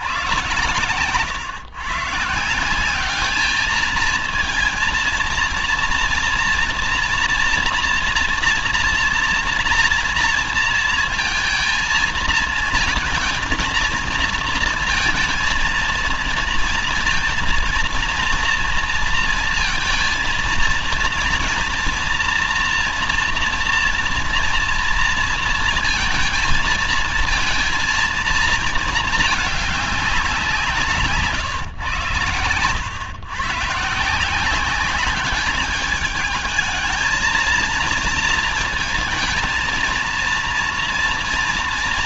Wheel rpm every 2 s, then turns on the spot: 120, 170, 230, 230, 230, 230, 230, 230, 230, 230, 230, 240, 230, 220, 230, 180, 110, 180, 220, 220, 230.
none